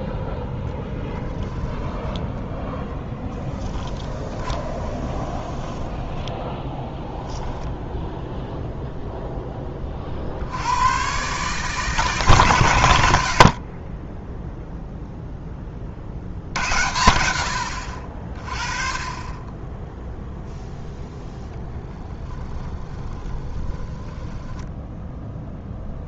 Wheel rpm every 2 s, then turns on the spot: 0, 0, 20, 10, 0, 90, 100, 0, 80, 30, 0, 10, 10.
4-8 22-26